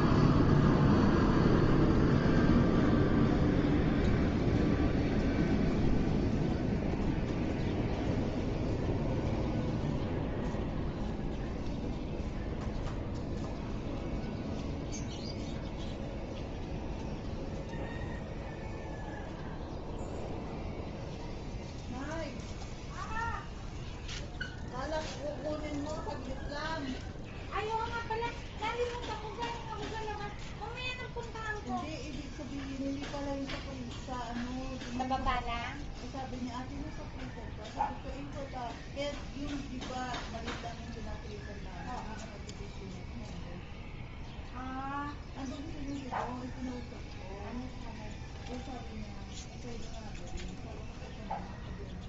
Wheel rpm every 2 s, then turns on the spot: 0, 0, 0, 0, 0, 0, 0, 0, 0, 0, 0, 0, 0, 0, 0, 0, 0, 0, 0, 0, 0, 0, 0, 0, 0, 0.
none